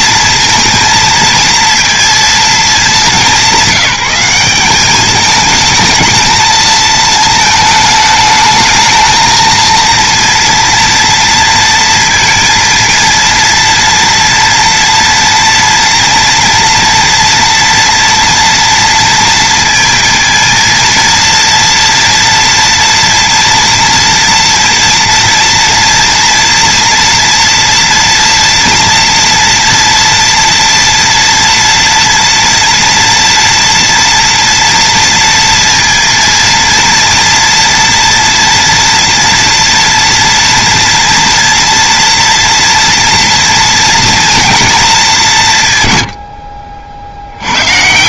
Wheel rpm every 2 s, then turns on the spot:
230, 200, 200, 220, 220, 230, 230, 230, 230, 230, 230, 240, 230, 230, 230, 240, 240, 230, 230, 230, 230, 240, 210, 60.
none